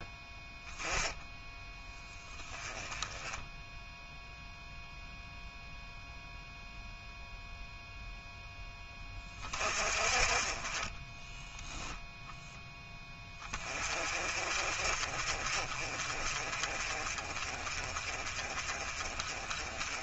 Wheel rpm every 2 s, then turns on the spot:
10, 10, 0, 0, 20, 20, 10, 40, 30, 30.
none